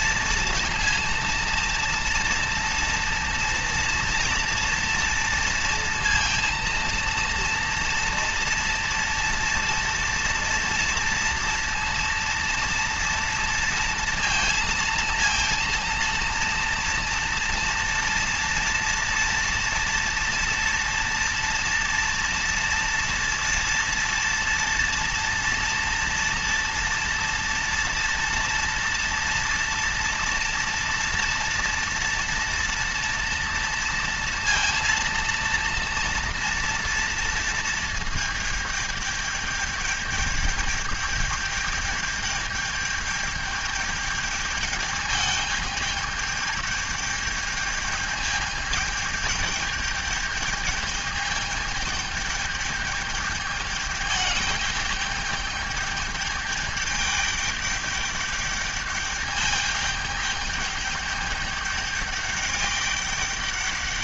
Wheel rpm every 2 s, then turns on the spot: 230, 230, 230, 230, 230, 230, 230, 230, 230, 230, 240, 230, 230, 230, 230, 230, 230, 230, 230, 220, 210, 210, 210, 210, 210, 210, 210, 210, 210, 210, 210, 210.
none